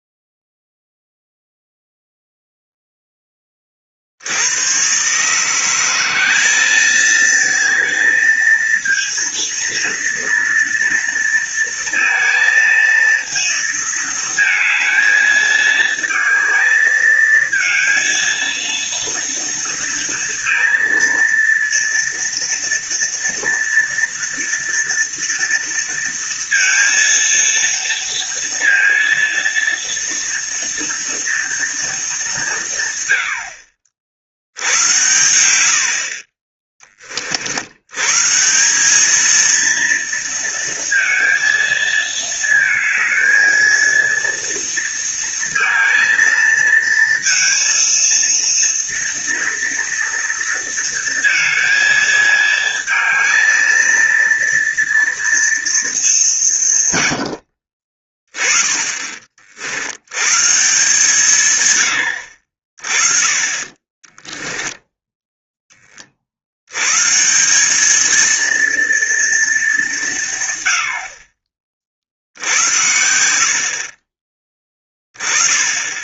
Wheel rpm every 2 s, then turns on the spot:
0, 0, 100, 210, 230, 230, 230, 220, 220, 230, 230, 230, 230, 230, 230, 230, 160, 80, 20, 180, 230, 220, 230, 230, 230, 230, 220, 230, 140, 30, 140, 50, 0, 100, 230, 100, 70, 10.
none